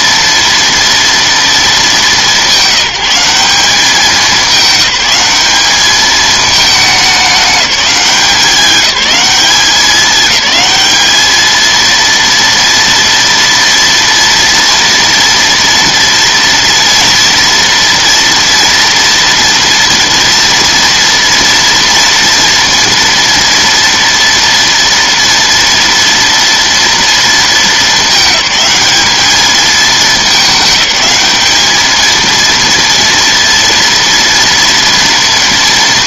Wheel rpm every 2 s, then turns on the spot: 230, 180, 200, 210, 190, 200, 230, 230, 240, 230, 230, 230, 230, 230, 210, 210, 230, 230.
none